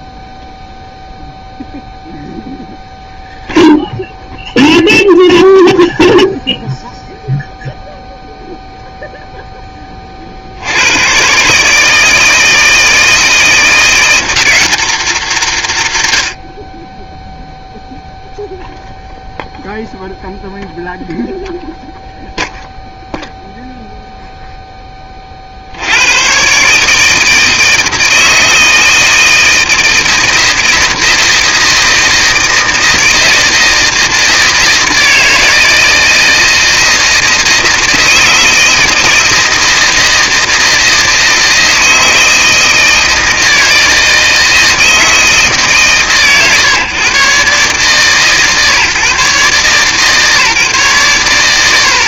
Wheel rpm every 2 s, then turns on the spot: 0, 0, 0, 0, 0, 80, 160, 210, 50, 0, 0, 0, 10, 140, 160, 160, 170, 160, 160, 160, 160, 160, 160, 120, 130, 130.
none